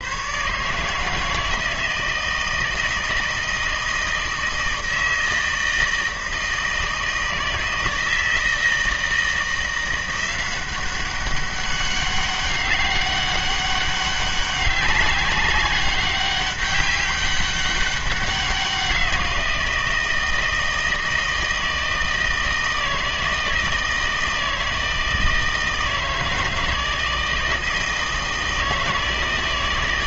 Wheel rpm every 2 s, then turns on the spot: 140, 160, 160, 160, 160, 190, 200, 200, 200, 190, 160, 160, 160, 160, 160.
none